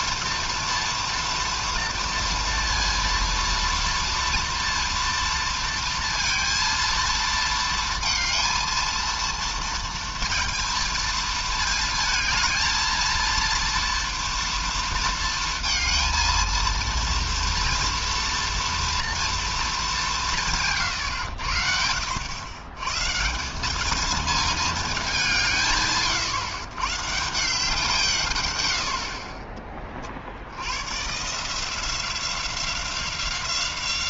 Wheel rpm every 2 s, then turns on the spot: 230, 230, 230, 230, 230, 230, 220, 230, 230, 230, 160, 110, 230, 130, 110, 70, 180.
none